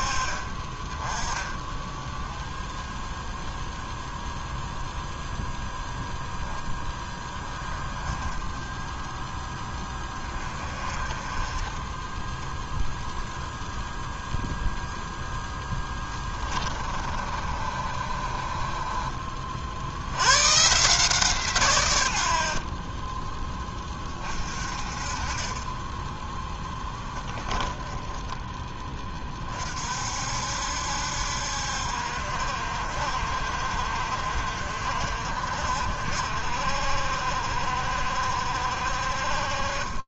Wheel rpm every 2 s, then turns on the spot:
20, 0, 0, 10, 10, 20, 0, 0, 30, 30, 150, 30, 40, 10, 20, 70, 50, 40, 50, 40.
16-20 22-24 26-28